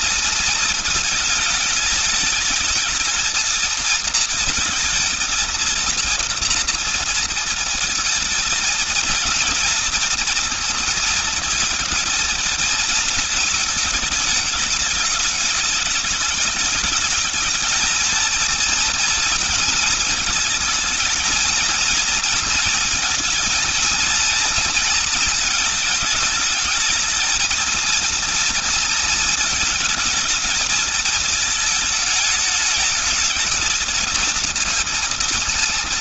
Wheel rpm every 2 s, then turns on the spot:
220, 210, 220, 230, 230, 230, 220, 210, 210, 230, 220, 230, 230, 220, 230, 220, 210, 220.
none